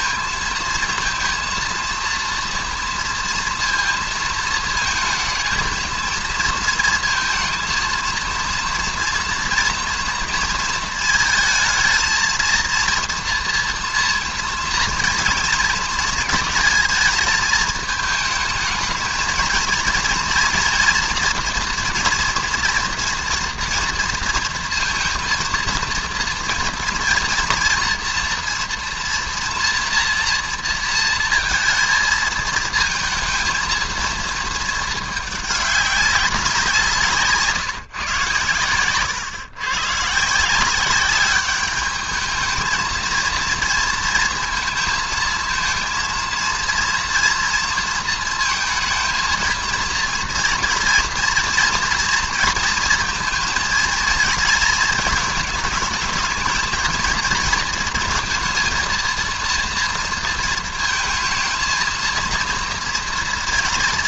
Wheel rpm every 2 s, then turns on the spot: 230, 230, 230, 220, 230, 230, 230, 230, 230, 220, 230, 240, 230, 230, 230, 230, 220, 220, 180, 120, 170, 220, 230, 230, 230, 230, 230, 230, 220, 230, 230, 230.
none